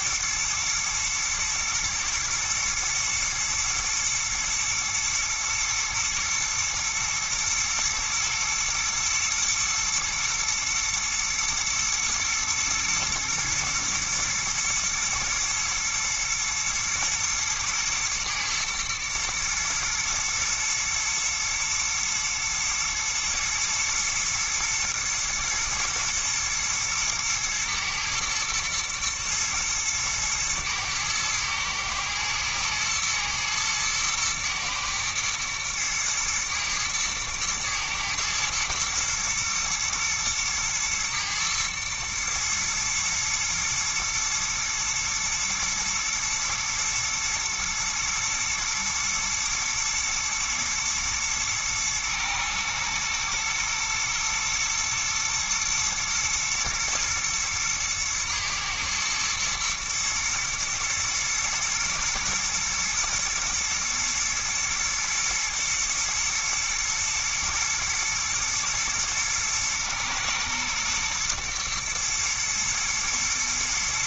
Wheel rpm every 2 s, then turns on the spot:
110, 110, 110, 120, 110, 120, 120, 120, 120, 110, 110, 110, 120, 110, 110, 110, 120, 110, 110, 110, 110, 110, 120, 110, 110, 120, 110, 110, 110, 110, 110, 120, 120, 110, 120, 110, 120.
none